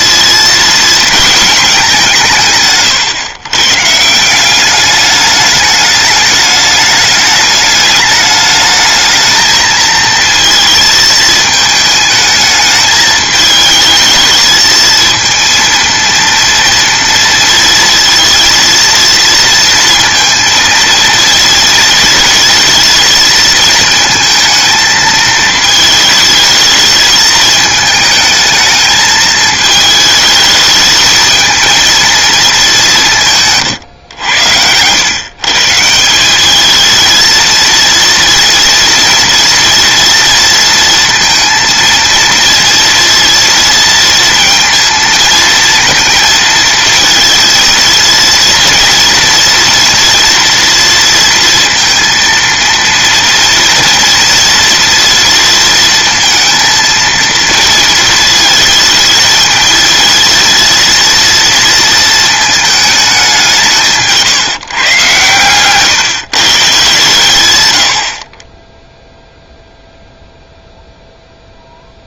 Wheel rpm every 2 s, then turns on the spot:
230, 140, 200, 210, 220, 220, 210, 230, 230, 230, 230, 220, 220, 220, 220, 210, 180, 110, 220, 230, 230, 230, 230, 230, 230, 230, 230, 230, 230, 220, 230, 210, 130, 130, 0, 0.
none